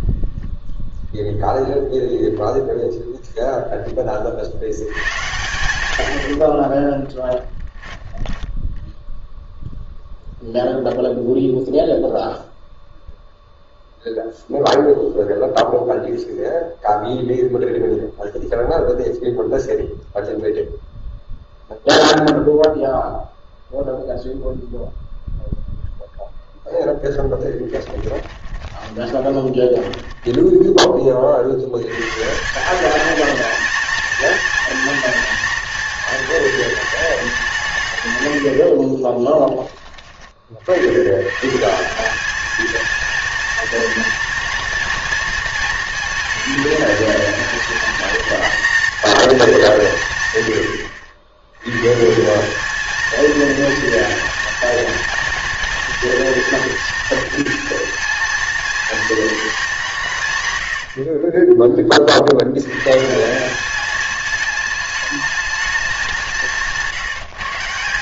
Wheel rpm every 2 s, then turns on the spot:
0, 0, 90, 50, 10, 0, 0, 0, 0, 0, 0, 0, 0, 0, 20, 20, 200, 230, 220, 60, 90, 230, 230, 220, 230, 100, 220, 230, 230, 230, 90, 120, 220, 170.
6-8 28-30 38-40 60-62